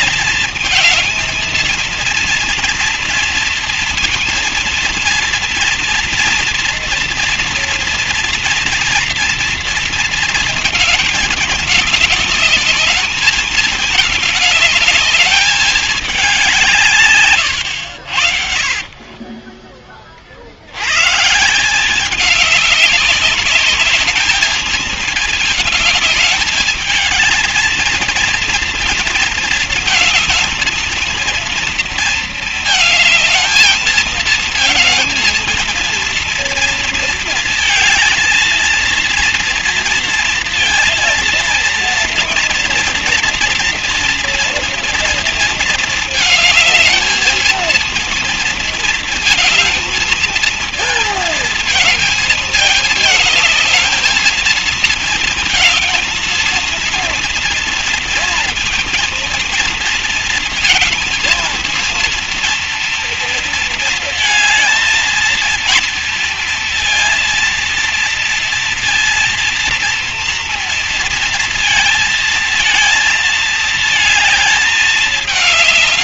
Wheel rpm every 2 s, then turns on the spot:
220, 230, 230, 230, 230, 230, 220, 220, 200, 70, 40, 190, 210, 210, 230, 220, 230, 220, 230, 230, 230, 230, 230, 220, 230, 230, 220, 220, 230, 230, 230, 230, 220, 230, 230, 240, 220, 220.
18-20